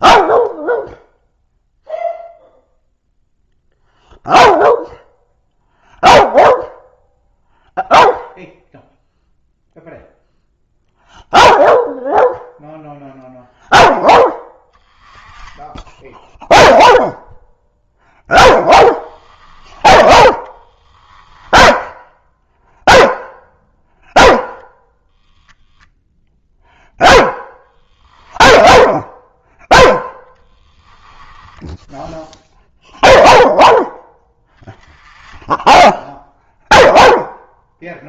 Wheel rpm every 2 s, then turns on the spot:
0, 0, 0, 0, 0, 0, 0, 10, 0, 10, 10, 0, 0, 0, 0, 10, 0, 10, 0.
18-22 30-32